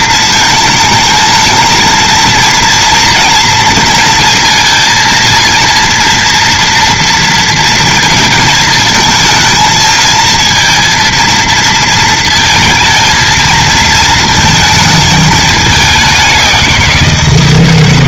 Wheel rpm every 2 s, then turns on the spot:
220, 230, 230, 230, 220, 230, 230, 220, 180.
none